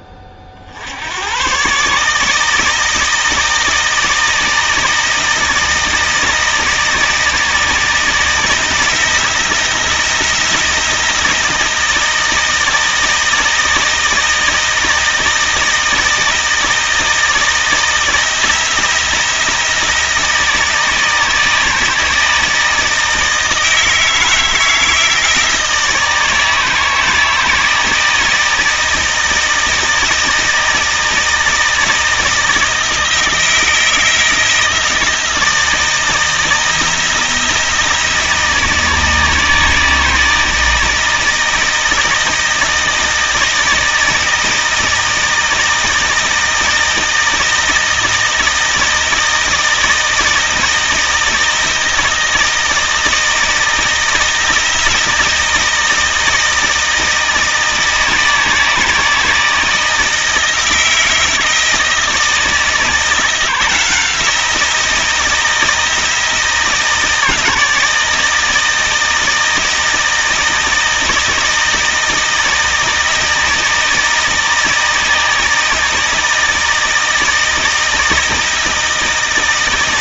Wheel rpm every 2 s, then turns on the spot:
80, 160, 160, 160, 170, 170, 160, 160, 160, 170, 160, 160, 160, 160, 160, 160, 160, 160, 160, 160, 160, 160, 160, 160, 160, 160, 160, 170, 160, 160, 160, 160, 170, 160, 160, 160, 160, 160, 160, 160.
none